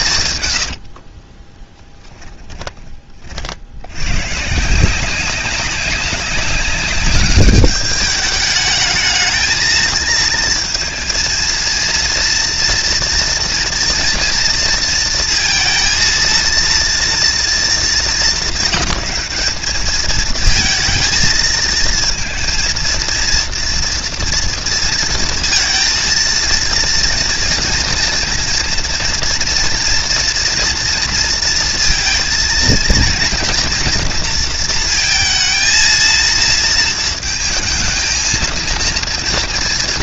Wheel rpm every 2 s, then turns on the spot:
60, 40, 170, 200, 210, 230, 240, 230, 230, 200, 220, 230, 230, 230, 230, 230, 230, 230, 230, 230.
0-2